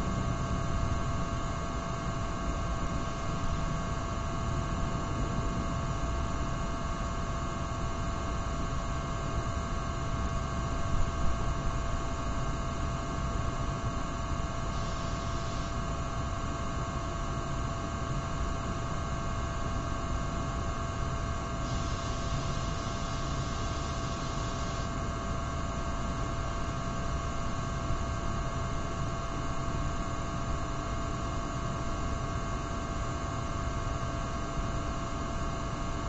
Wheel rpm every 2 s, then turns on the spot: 0, 0, 0, 0, 0, 0, 0, 0, 0, 0, 0, 0, 0, 0, 0, 0, 0, 0.
none